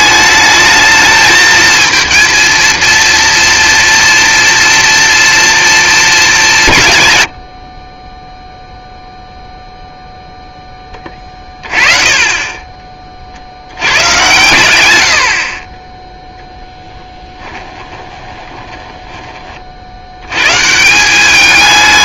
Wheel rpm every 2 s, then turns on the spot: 220, 230, 230, 180, 0, 10, 20, 100, 0, 20, 140.
18-20